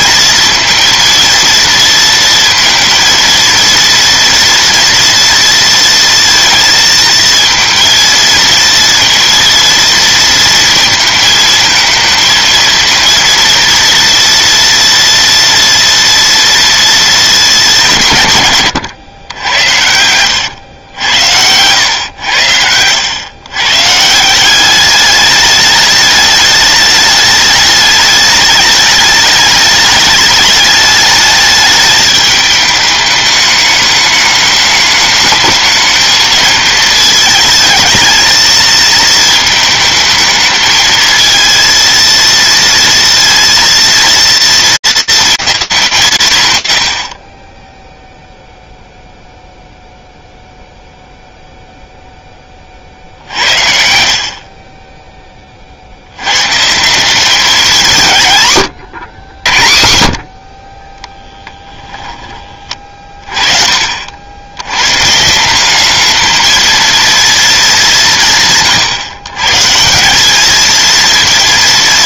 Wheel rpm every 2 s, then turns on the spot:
230, 230, 230, 230, 230, 230, 230, 230, 230, 120, 90, 90, 200, 210, 210, 210, 210, 210, 220, 220, 220, 230, 230, 80, 0, 0, 40, 30, 190, 110, 20, 30, 150, 230, 130, 230.
54-56 60-62